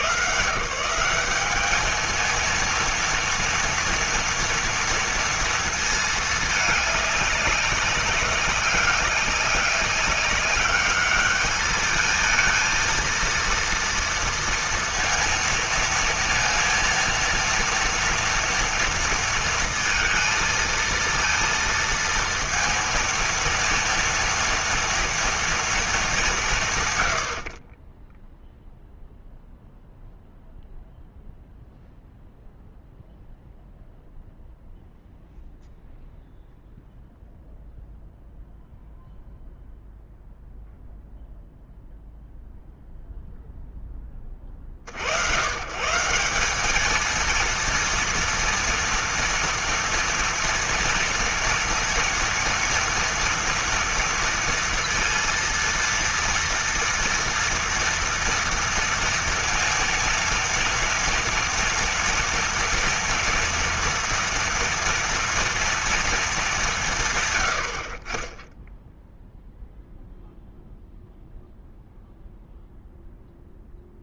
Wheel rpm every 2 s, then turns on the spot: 100, 230, 230, 210, 200, 200, 230, 230, 230, 230, 230, 230, 230, 190, 10, 0, 0, 0, 0, 0, 0, 0, 30, 200, 230, 230, 230, 230, 230, 230, 230, 230, 230, 200, 20, 0, 0.
none